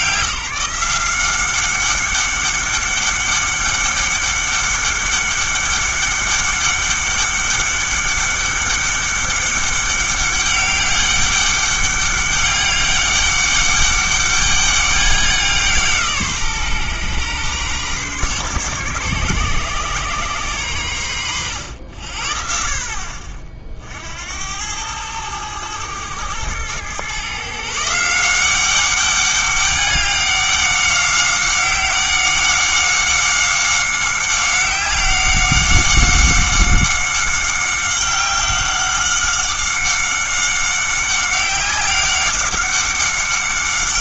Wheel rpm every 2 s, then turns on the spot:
170, 200, 200, 200, 200, 200, 200, 200, 130, 130, 100, 50, 100, 120, 190, 190, 190, 190, 190, 190, 190, 200.
none